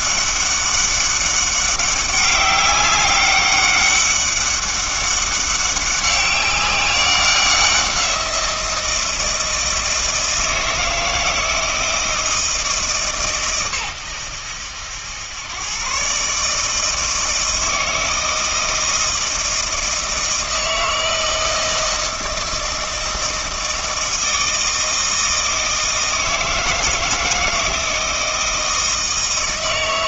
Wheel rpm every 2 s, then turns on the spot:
200, 200, 200, 190, 170, 160, 160, 90, 150, 160, 160, 160, 160, 160, 160.
none